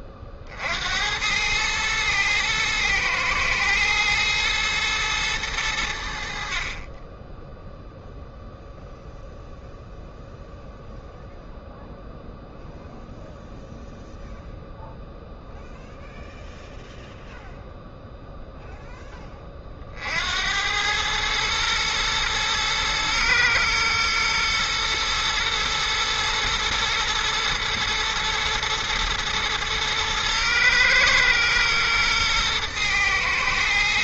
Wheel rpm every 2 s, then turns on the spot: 70, 110, 110, 30, 0, 0, 0, 0, 0, 10, 100, 110, 120, 120, 120, 120, 110.
none